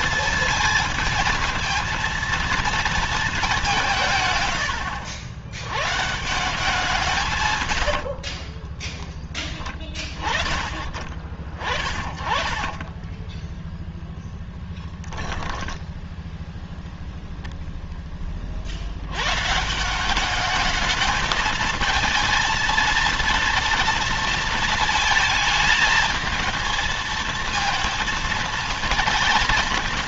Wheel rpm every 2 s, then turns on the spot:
220, 230, 90, 160, 20, 40, 30, 10, 20, 60, 210, 230, 230, 220, 220.
8-10 12-16